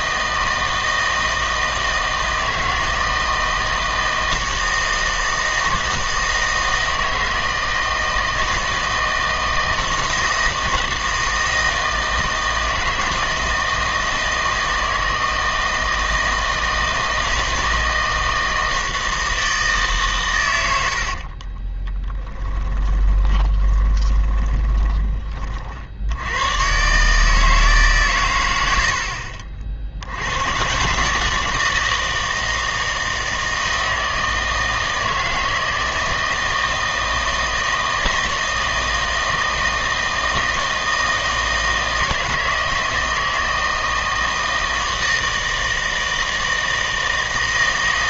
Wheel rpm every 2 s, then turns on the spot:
160, 160, 160, 160, 160, 160, 160, 160, 160, 160, 100, 10, 20, 120, 90, 130, 160, 160, 160, 160, 160, 160, 160, 160.
22-26